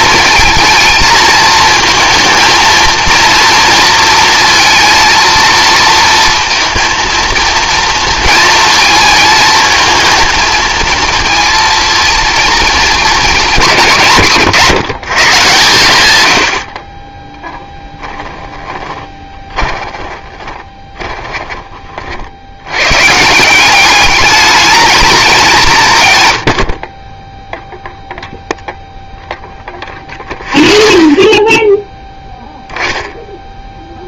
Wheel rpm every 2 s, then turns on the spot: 230, 230, 230, 230, 220, 220, 220, 140, 50, 10, 20, 100, 210, 60, 0, 0, 0.
18-22